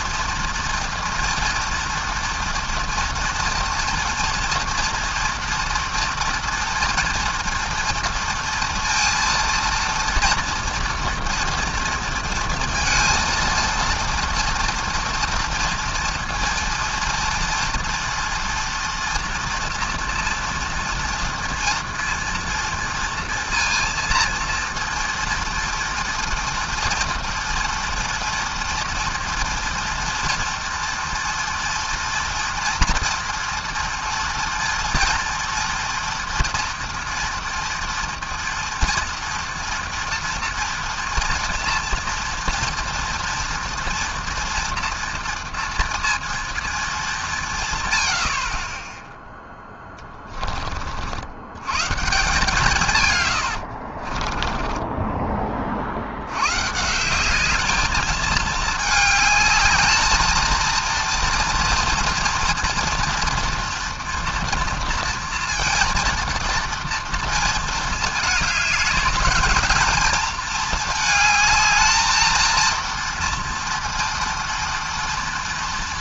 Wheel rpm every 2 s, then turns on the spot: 240, 230, 230, 230, 230, 230, 230, 240, 230, 230, 230, 230, 230, 230, 240, 240, 230, 230, 230, 230, 240, 230, 230, 210, 10, 50, 130, 20, 160, 220, 230, 230, 230, 230, 210, 220, 230, 230.
54-56